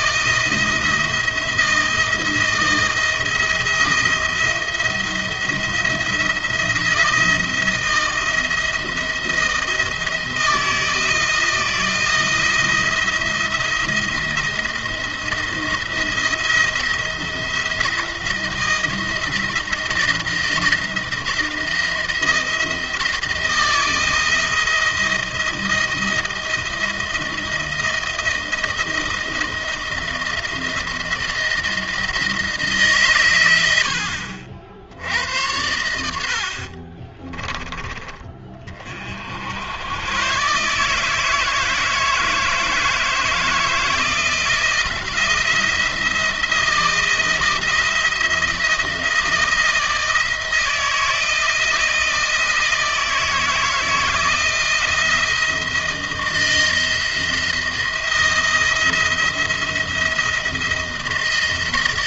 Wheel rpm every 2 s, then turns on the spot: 170, 170, 170, 170, 170, 160, 170, 170, 170, 170, 170, 170, 170, 170, 160, 160, 140, 70, 50, 50, 140, 160, 170, 170, 160, 160, 160, 160, 170, 170, 170.
36-38